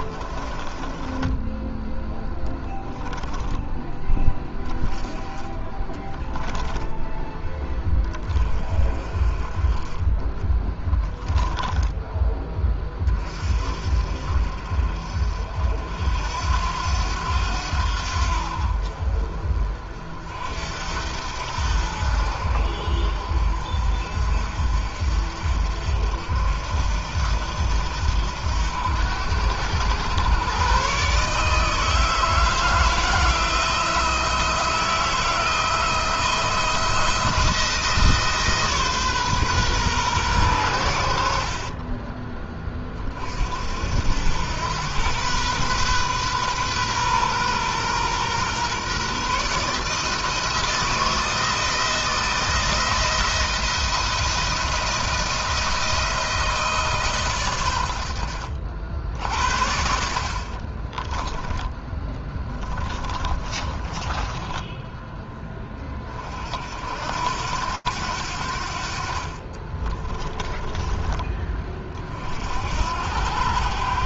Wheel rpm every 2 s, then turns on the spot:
20, 10, 10, 10, 30, 30, 20, 50, 90, 50, 70, 60, 50, 70, 80, 130, 160, 160, 170, 150, 90, 30, 110, 130, 130, 160, 170, 170, 150, 60, 30, 20, 10, 70, 50, 20, 70.
0-2 10-12 60-64 70-72